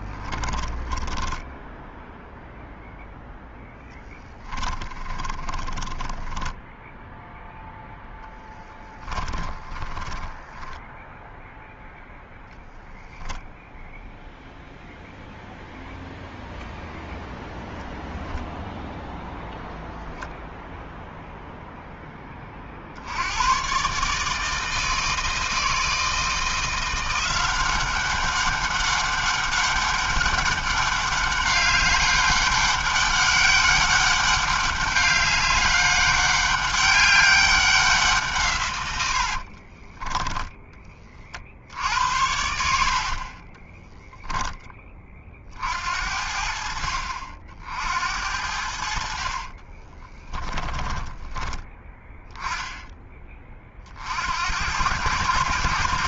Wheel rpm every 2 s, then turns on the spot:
10, 0, 20, 0, 20, 10, 0, 0, 0, 0, 0, 80, 160, 170, 200, 200, 200, 200, 200, 80, 30, 50, 30, 60, 60, 20, 20, 100.
0-2 4-6 8-12 38-40 42-44 48-52